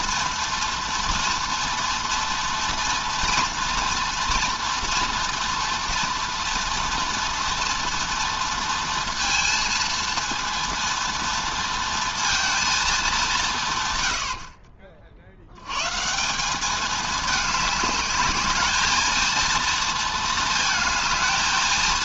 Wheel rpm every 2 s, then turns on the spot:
230, 240, 230, 230, 230, 230, 230, 70, 200, 220, 220.
none